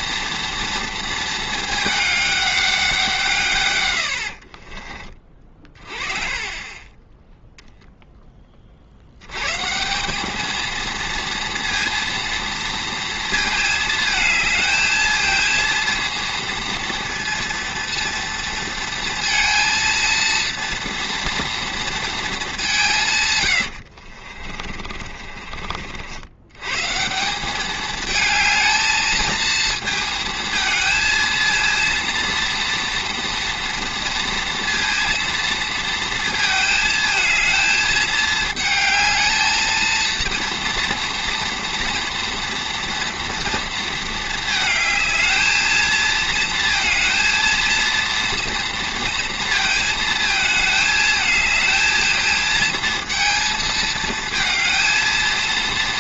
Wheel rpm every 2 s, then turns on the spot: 230, 200, 50, 30, 40, 220, 230, 220, 230, 230, 230, 200, 40, 120, 220, 220, 230, 230, 230, 220, 230, 240, 220, 230, 230, 220, 230, 220.
4-6 24-26